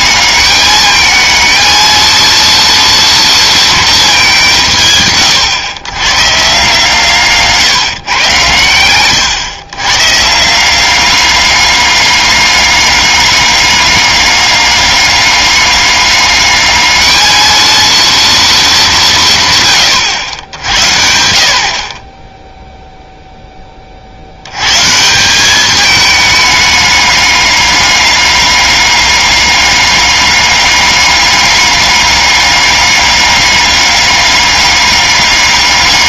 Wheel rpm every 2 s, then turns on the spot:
210, 230, 150, 150, 120, 180, 200, 200, 210, 220, 80, 0, 130, 210, 200, 200, 200, 200.
none